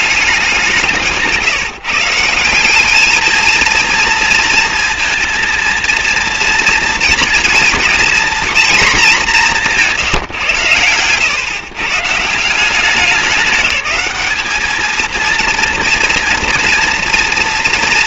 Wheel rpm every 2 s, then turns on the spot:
170, 200, 230, 230, 220, 110, 190, 220, 230.
none